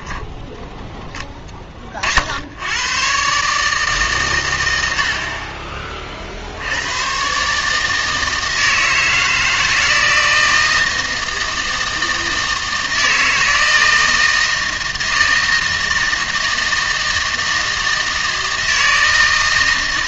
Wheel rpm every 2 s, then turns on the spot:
10, 90, 110, 70, 160, 160, 160, 160, 160, 160.
none